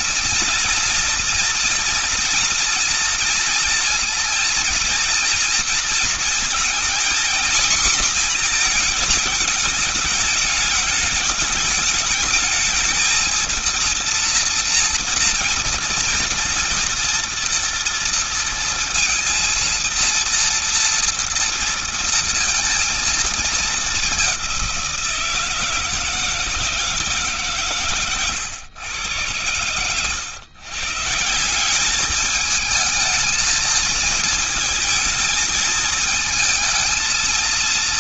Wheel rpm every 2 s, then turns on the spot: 240, 240, 230, 230, 230, 210, 210, 230, 230, 230, 230, 230, 200, 160, 120, 120, 210, 220, 220.
none